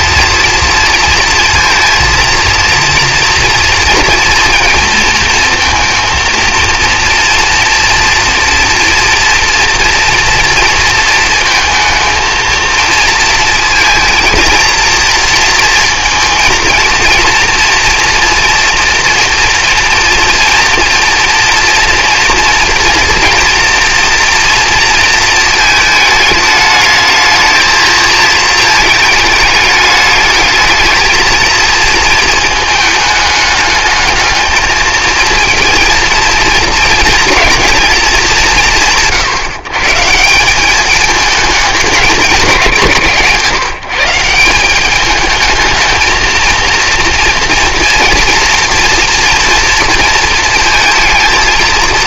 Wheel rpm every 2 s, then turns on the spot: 230, 230, 230, 230, 230, 230, 230, 230, 230, 230, 230, 230, 230, 210, 220, 210, 220, 220, 230, 190, 190, 180, 190, 230, 230, 230.
none